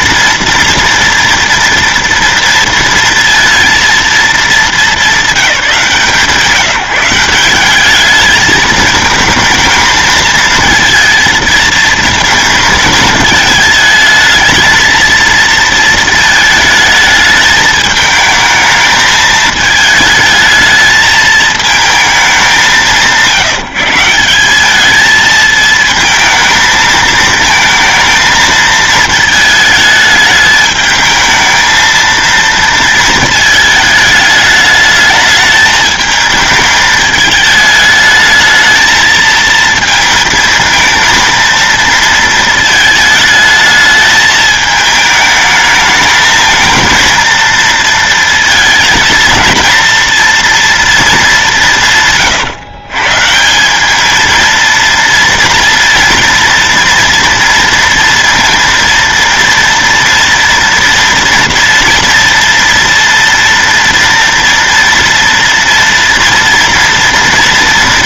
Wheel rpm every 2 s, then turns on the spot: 230, 230, 230, 170, 220, 230, 220, 220, 220, 220, 220, 180, 210, 220, 220, 220, 230, 210, 210, 220, 220, 220, 220, 230, 220, 230, 130, 230, 230, 230, 230, 230, 230, 230.
none